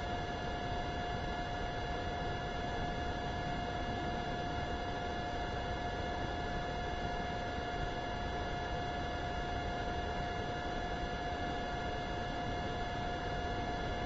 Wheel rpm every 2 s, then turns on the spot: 0, 0, 0, 0, 0, 0, 0.
none